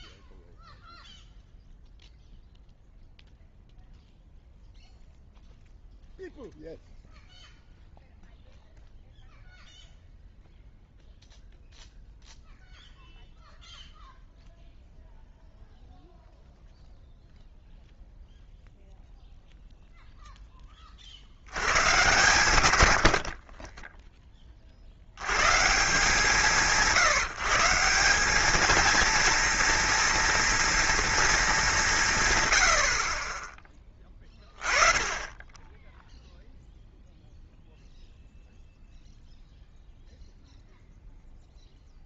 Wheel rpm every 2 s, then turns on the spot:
0, 0, 0, 0, 0, 0, 0, 0, 0, 0, 20, 100, 40, 160, 210, 230, 80, 20, 0, 0, 0.
none